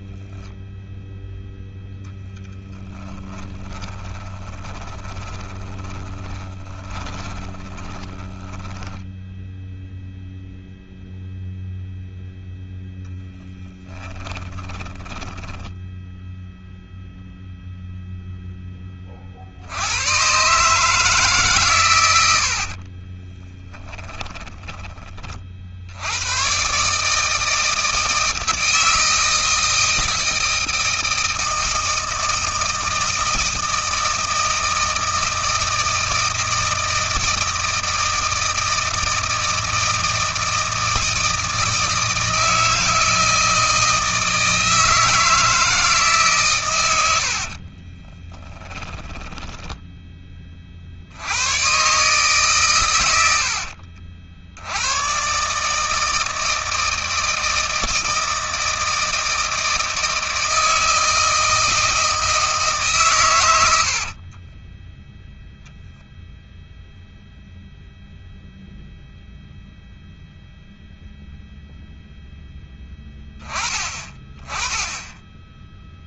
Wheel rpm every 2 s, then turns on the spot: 0, 10, 20, 10, 10, 0, 10, 10, 0, 20, 150, 60, 20, 140, 160, 160, 160, 160, 160, 160, 160, 160, 160, 100, 10, 70, 100, 120, 160, 160, 160, 130, 10, 0, 0, 0, 10, 10.
2-8 14-16 22-24 48-50